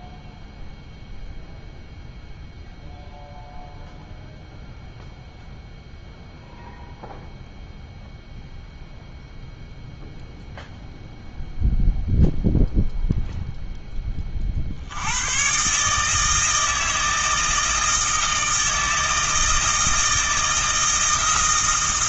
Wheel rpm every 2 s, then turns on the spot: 0, 0, 0, 0, 0, 0, 0, 70, 160, 160, 160.
none